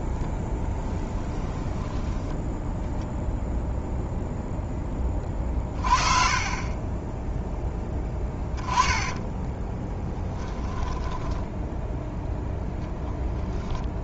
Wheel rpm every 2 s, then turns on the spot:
10, 0, 10, 20, 10, 10, 0.
0-2 6-12